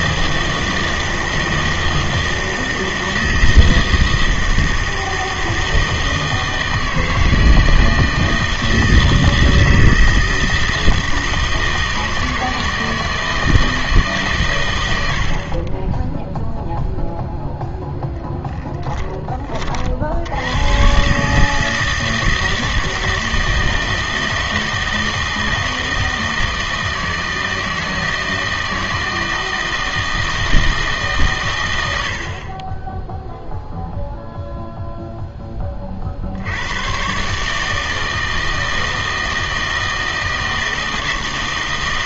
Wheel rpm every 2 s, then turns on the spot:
160, 160, 160, 160, 160, 160, 160, 100, 0, 10, 110, 160, 160, 160, 160, 160, 20, 0, 100, 160, 160.
none